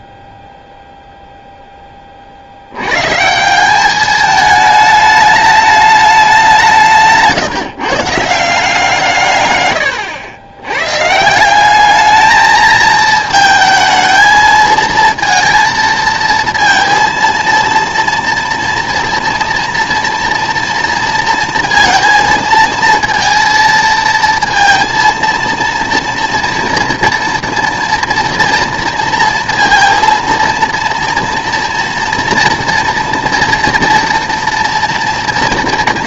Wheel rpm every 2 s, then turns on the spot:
0, 70, 210, 180, 160, 100, 220, 220, 230, 230, 230, 220, 230, 230, 230, 230, 240, 240.
none